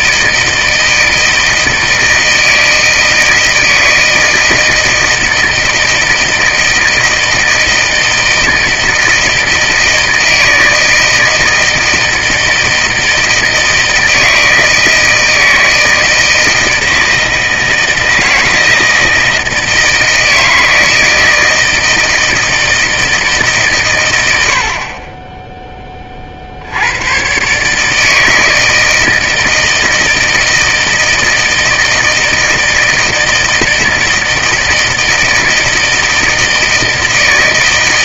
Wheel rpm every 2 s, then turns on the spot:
160, 160, 160, 160, 160, 160, 160, 160, 160, 160, 160, 160, 80, 70, 160, 160, 160, 160, 160.
none